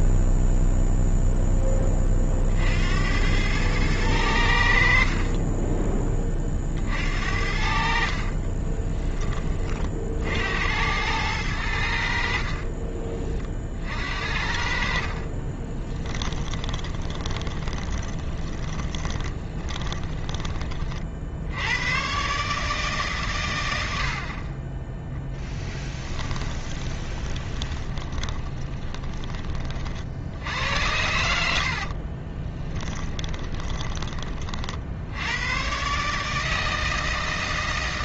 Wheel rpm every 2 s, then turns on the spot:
0, 80, 40, 60, 20, 90, 30, 40, 20, 20, 50, 140, 10, 20, 20, 80, 10, 70, 160.
14-20 26-28 32-34